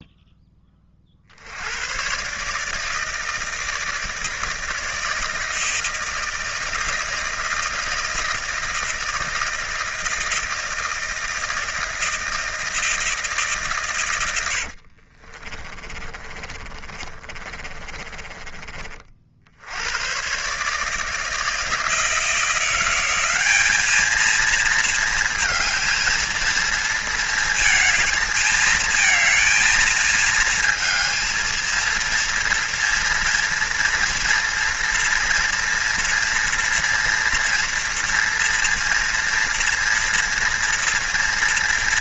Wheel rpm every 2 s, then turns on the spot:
30, 150, 160, 160, 160, 170, 160, 60, 30, 40, 150, 170, 230, 220, 220, 220, 230, 230, 230, 230, 230.
14-18